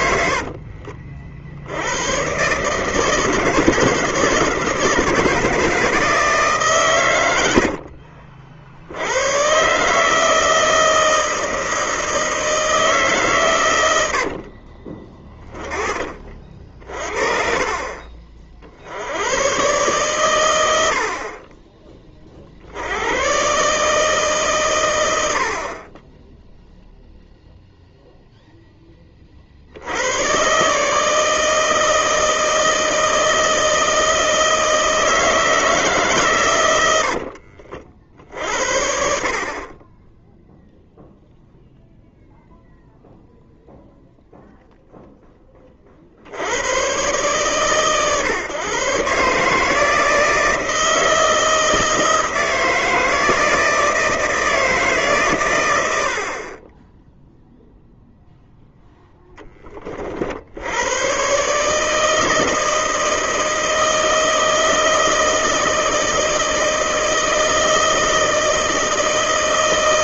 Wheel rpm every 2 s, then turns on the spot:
50, 150, 150, 120, 70, 160, 160, 30, 50, 70, 80, 80, 110, 0, 30, 150, 160, 160, 90, 60, 0, 0, 0, 110, 130, 160, 160, 150, 10, 0, 100, 160, 160, 160, 160.
14-16